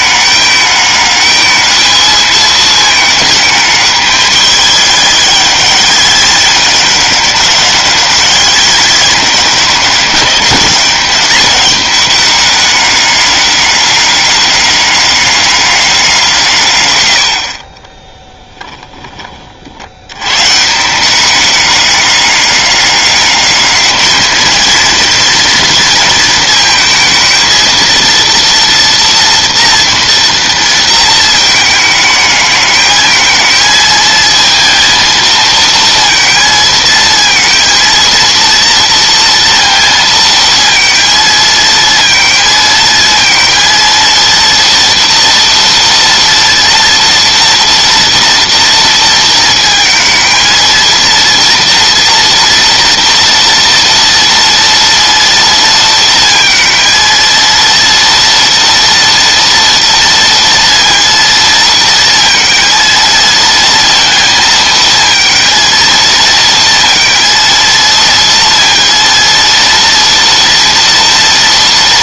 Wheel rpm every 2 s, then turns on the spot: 210, 220, 210, 200, 210, 200, 200, 200, 120, 10, 150, 200, 230, 220, 230, 230, 220, 230, 230, 230, 230, 220, 230, 230, 230, 230, 230, 230, 230, 230, 230, 230, 220, 230, 230, 230.
18-20